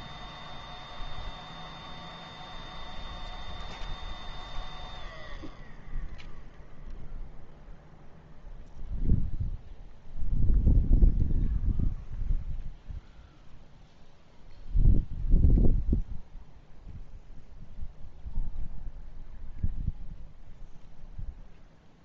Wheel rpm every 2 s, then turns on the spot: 0, 0, 0, 0, 0, 0, 0, 0, 0, 0, 0.
none